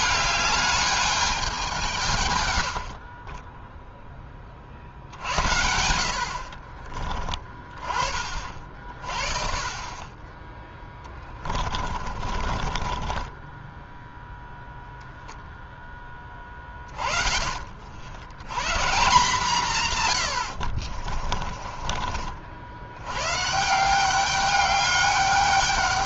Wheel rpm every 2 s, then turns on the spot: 210, 50, 60, 30, 30, 10, 20, 0, 20, 140, 50, 100, 200.
2-4 10-14 20-22